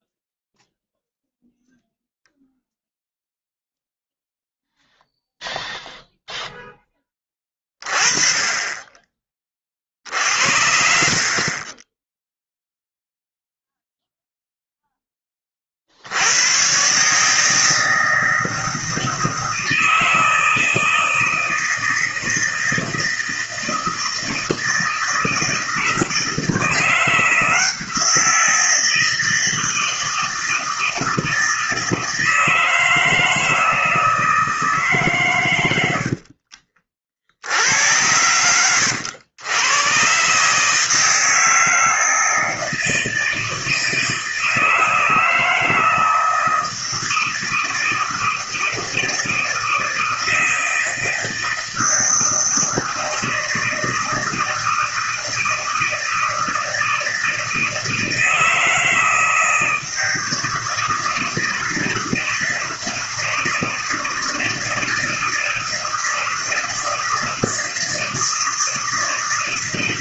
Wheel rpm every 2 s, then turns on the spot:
0, 0, 0, 10, 20, 60, 0, 0, 120, 160, 160, 160, 160, 170, 160, 160, 160, 150, 40, 110, 160, 160, 160, 160, 160, 160, 160, 160, 160, 160, 160, 160, 160, 160, 160.
none